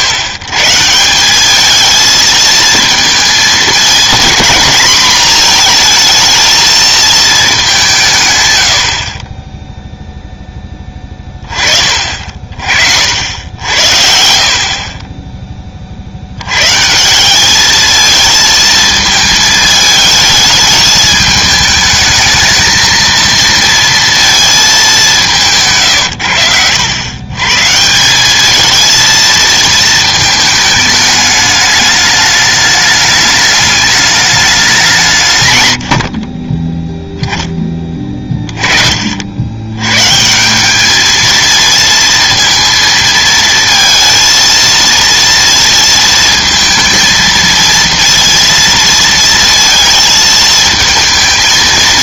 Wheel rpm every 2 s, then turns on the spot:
140, 220, 230, 230, 100, 10, 40, 50, 110, 220, 210, 220, 220, 80, 220, 220, 210, 200, 20, 30, 190, 230, 230, 220, 230, 220.
none